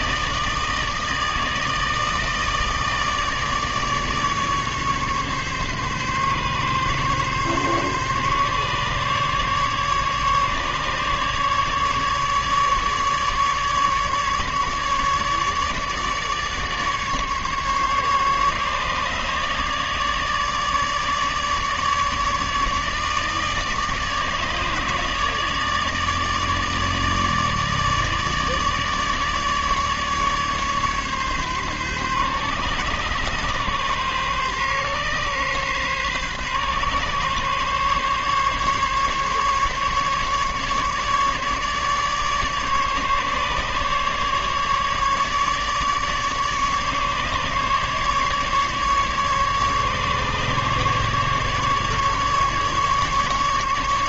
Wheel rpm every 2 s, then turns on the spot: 160, 150, 140, 140, 140, 150, 150, 150, 140, 150, 150, 150, 150, 150, 150, 140, 130, 130, 140, 140, 150, 140, 150, 140, 150, 150, 150.
none